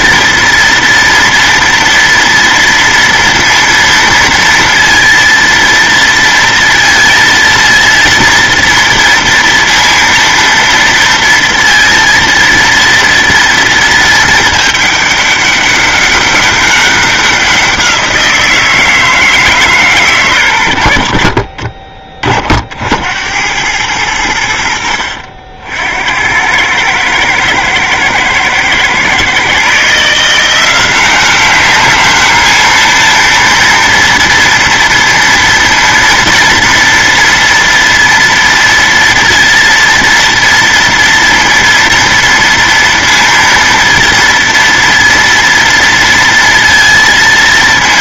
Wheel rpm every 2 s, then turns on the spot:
230, 230, 230, 230, 230, 230, 230, 220, 200, 170, 120, 30, 90, 80, 110, 160, 210, 230, 230, 230, 230, 230, 230, 230.
none